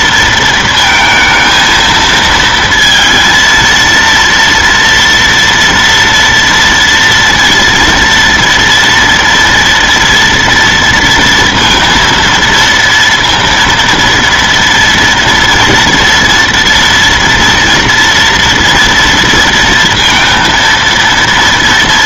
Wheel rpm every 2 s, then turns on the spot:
230, 230, 230, 230, 230, 230, 230, 240, 240, 230, 230.
none